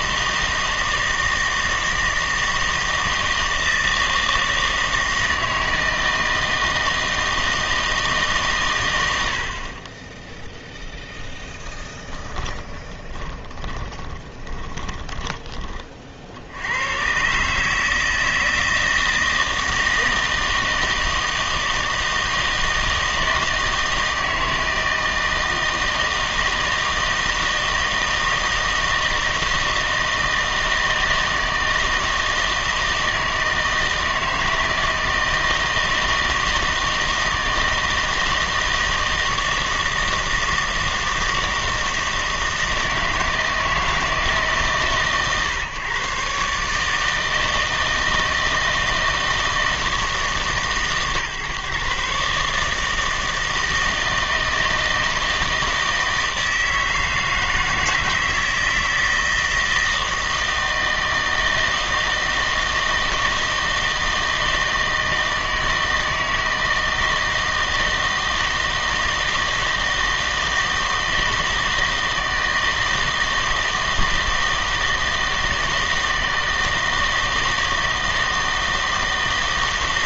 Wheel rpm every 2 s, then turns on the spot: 160, 160, 160, 160, 120, 0, 20, 20, 90, 160, 160, 160, 160, 160, 160, 160, 160, 160, 160, 160, 160, 160, 140, 140, 160, 140, 150, 160, 160, 160, 160, 160, 160, 160, 160, 160, 160, 160, 160, 160.
12-16